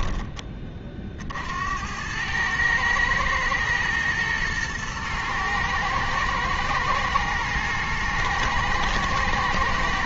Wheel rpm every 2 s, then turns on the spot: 40, 110, 110, 110, 120.
none